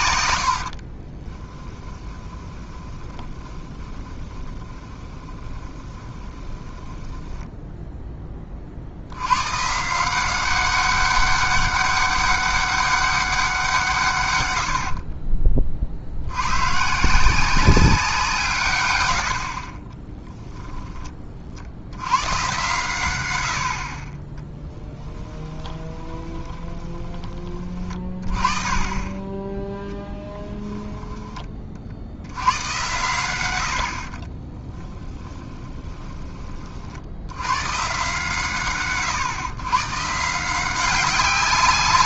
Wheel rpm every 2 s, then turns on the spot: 60, 20, 20, 10, 40, 190, 200, 80, 130, 120, 10, 110, 20, 20, 20, 10, 110, 30, 40, 130, 180.
0-8 14-16 24-28 30-32 34-36